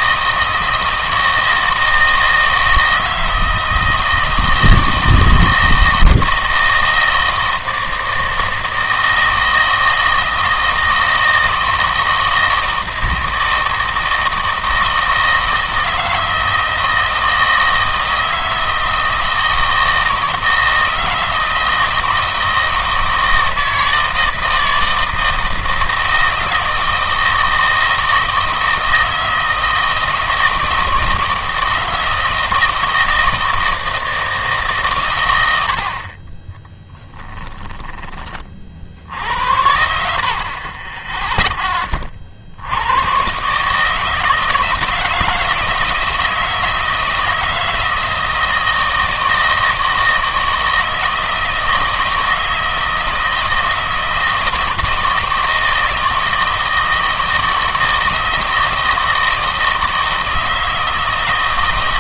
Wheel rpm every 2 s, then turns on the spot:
160, 160, 160, 160, 160, 160, 160, 160, 160, 160, 160, 160, 160, 160, 160, 160, 160, 140, 20, 40, 30, 80, 160, 160, 160, 160, 160, 160, 160, 160, 160.
36-38